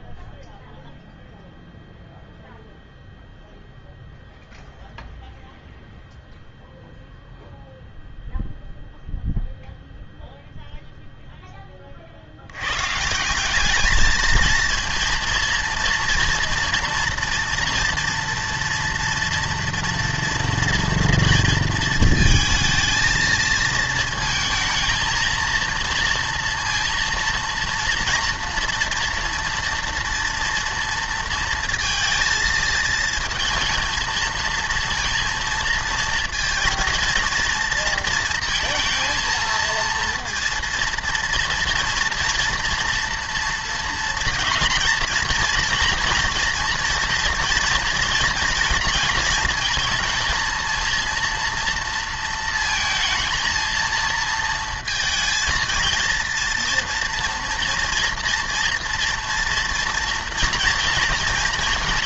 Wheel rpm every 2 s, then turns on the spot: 0, 0, 0, 0, 0, 0, 110, 230, 240, 230, 230, 220, 230, 230, 230, 230, 230, 230, 230, 230, 230, 230, 230, 230, 230, 230, 230, 230, 240, 240, 230.
none